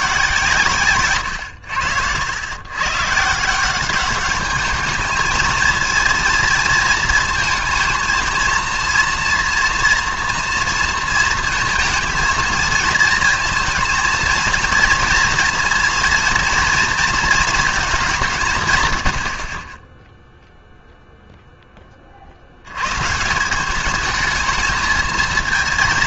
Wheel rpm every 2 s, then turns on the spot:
140, 130, 210, 230, 230, 230, 230, 230, 230, 140, 0, 100, 220.
none